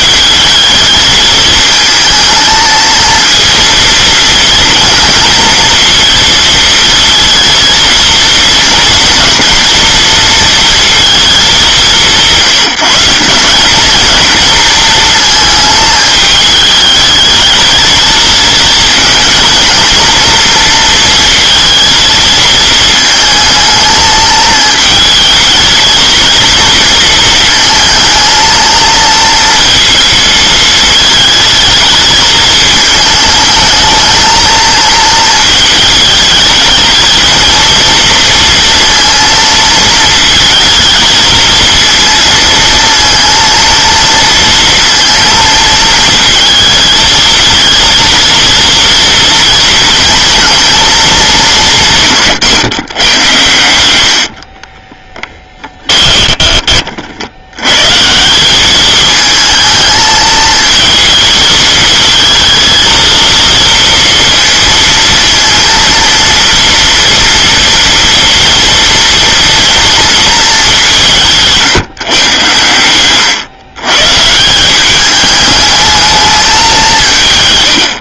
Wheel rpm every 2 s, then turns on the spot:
220, 220, 230, 230, 230, 230, 180, 220, 210, 220, 230, 220, 220, 230, 230, 220, 220, 230, 220, 230, 220, 230, 230, 220, 230, 230, 140, 40, 30, 190, 220, 220, 230, 230, 230, 200, 110, 170, 200.
54-56